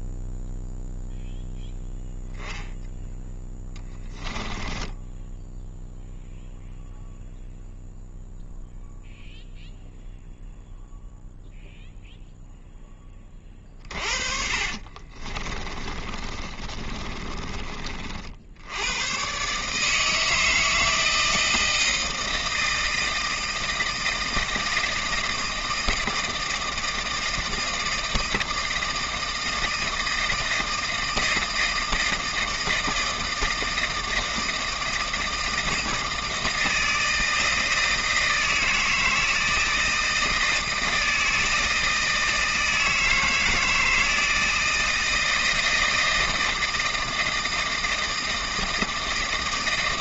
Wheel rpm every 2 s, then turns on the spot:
0, 0, 10, 0, 0, 0, 0, 40, 30, 90, 160, 160, 160, 160, 160, 160, 160, 160, 160, 160, 160, 160, 160, 160, 160.
4-6 14-18